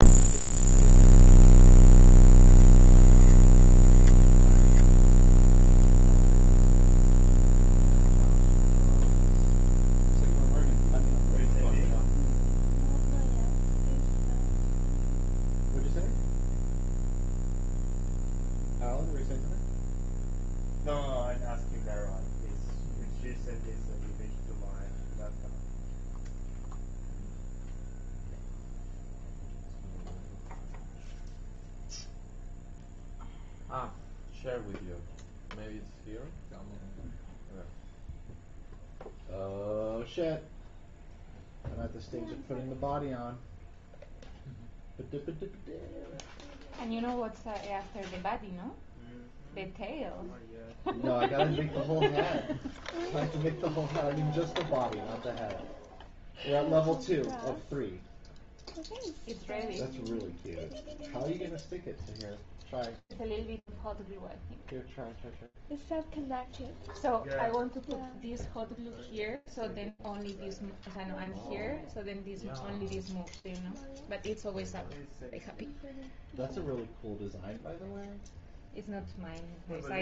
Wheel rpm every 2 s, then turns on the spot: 0, 0, 0, 0, 0, 0, 0, 0, 0, 0, 0, 0, 0, 0, 0, 0, 0, 0, 0, 0, 0, 0, 0, 0, 0, 0, 0, 0, 0, 0, 0, 0, 0, 0, 0, 0, 0, 0, 0, 0.
none